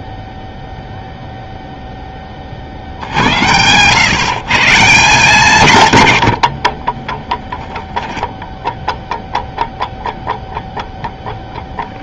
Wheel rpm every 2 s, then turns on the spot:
0, 50, 160, 50, 0, 0.
6-8